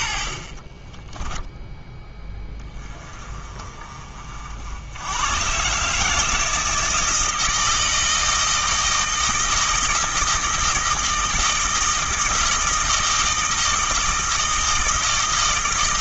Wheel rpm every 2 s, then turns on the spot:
20, 30, 100, 160, 160, 160, 160, 160.
0-2